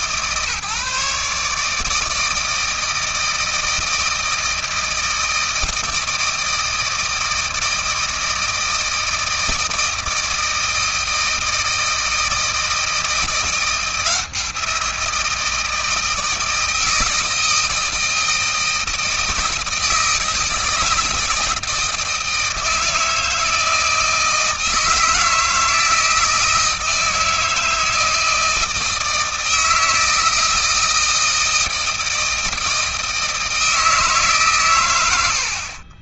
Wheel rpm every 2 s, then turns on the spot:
150, 160, 160, 160, 160, 160, 170, 170, 160, 160, 160, 160, 160, 160, 160, 160, 160, 110.
none